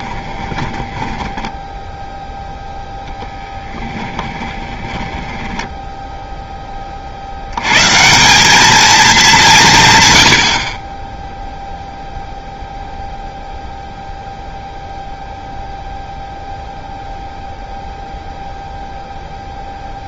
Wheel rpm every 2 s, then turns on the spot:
10, 0, 10, 10, 210, 80, 0, 0, 0, 0.
0-2 4-6